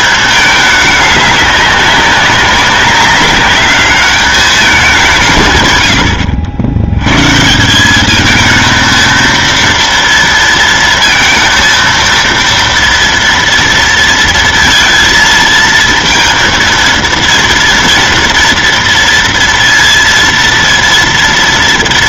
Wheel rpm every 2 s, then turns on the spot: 210, 190, 200, 80, 220, 230, 230, 230, 230, 230, 230.
none